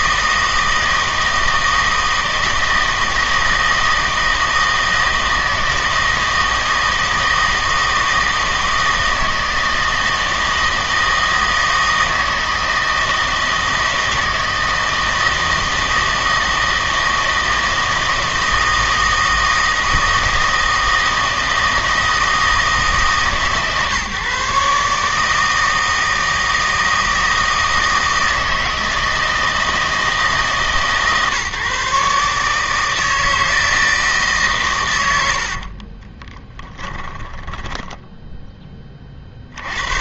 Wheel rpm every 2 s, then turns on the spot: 160, 160, 160, 160, 160, 160, 160, 160, 160, 160, 160, 160, 140, 160, 160, 150, 150, 120, 10, 10.
36-38